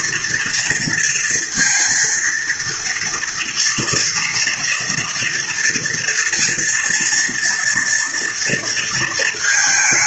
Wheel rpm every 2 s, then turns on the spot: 230, 230, 230, 230, 230.
none